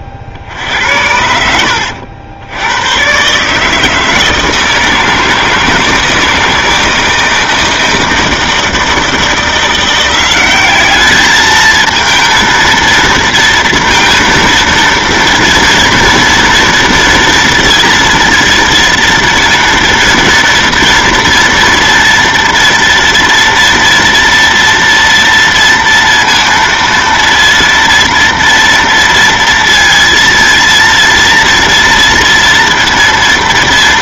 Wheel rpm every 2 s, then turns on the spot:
60, 90, 160, 160, 160, 200, 230, 230, 230, 230, 230, 230, 230, 230, 230, 230, 230.
none